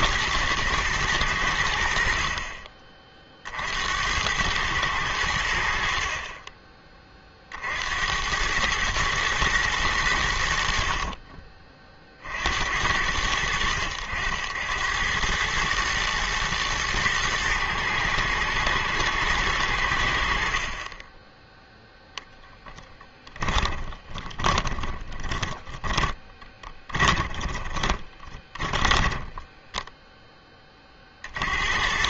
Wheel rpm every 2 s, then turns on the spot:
120, 30, 100, 20, 100, 60, 70, 80, 110, 120, 50, 10, 20, 20, 20, 20.
22-30